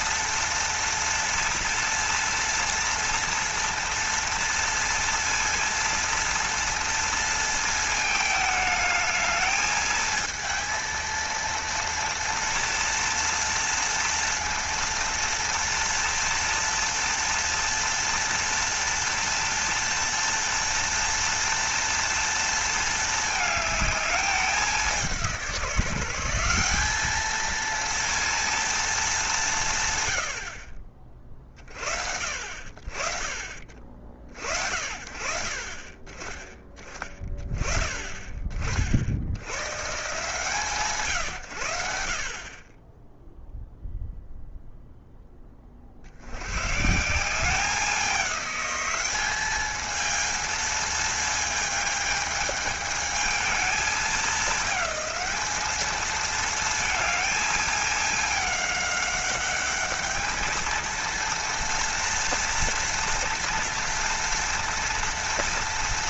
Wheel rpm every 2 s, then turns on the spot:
230, 230, 230, 230, 220, 220, 230, 230, 230, 230, 230, 220, 190, 190, 230, 50, 40, 60, 20, 30, 140, 20, 0, 130, 200, 230, 210, 210, 220, 200, 220, 230, 230.
none